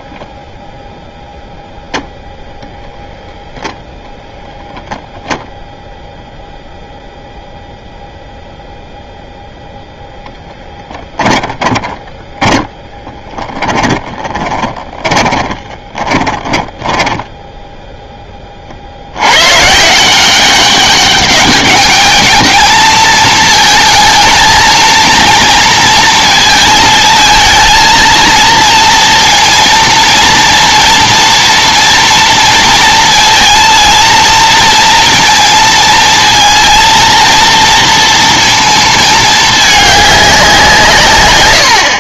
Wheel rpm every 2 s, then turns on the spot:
0, 0, 0, 0, 10, 10, 10, 20, 10, 160, 210, 230, 220, 230, 230, 230, 230, 230, 230, 210, 100.
10-16